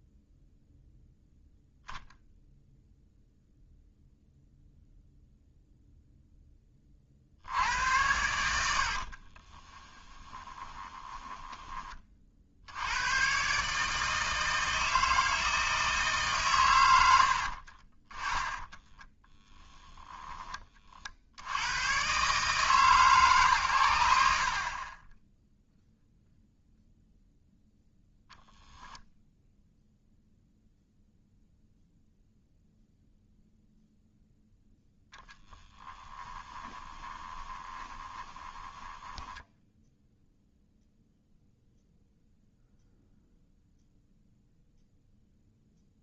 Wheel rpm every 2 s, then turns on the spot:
0, 0, 0, 20, 80, 10, 80, 160, 120, 10, 20, 150, 40, 0, 0, 0, 0, 10, 20, 10, 0, 0, 0.
10-12 18-20 36-40